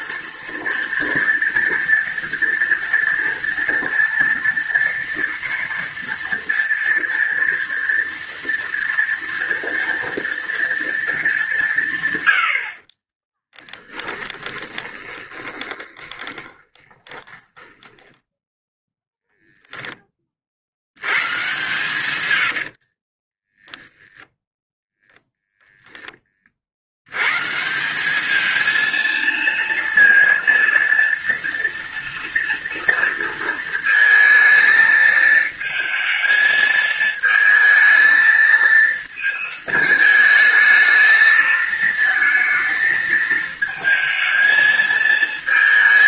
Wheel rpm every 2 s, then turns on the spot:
230, 230, 230, 230, 230, 230, 70, 10, 30, 0, 60, 80, 0, 40, 220, 230, 230, 220, 220, 220, 220, 220, 220.
14-18 22-24